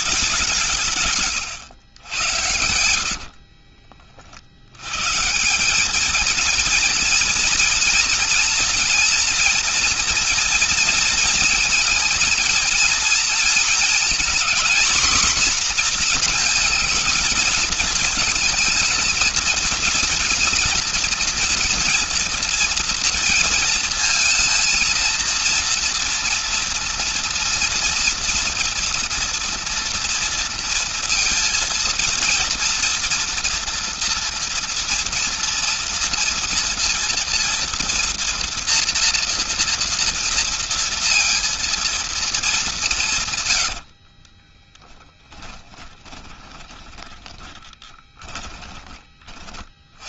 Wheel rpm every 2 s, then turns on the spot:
170, 80, 80, 230, 230, 230, 220, 240, 230, 220, 230, 240, 230, 240, 230, 230, 230, 230, 230, 240, 230, 190, 10, 20, 20.
2-4 44-48